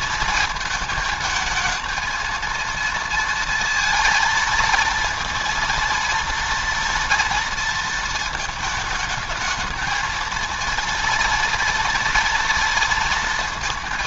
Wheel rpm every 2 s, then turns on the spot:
220, 230, 230, 230, 220, 230, 230.
none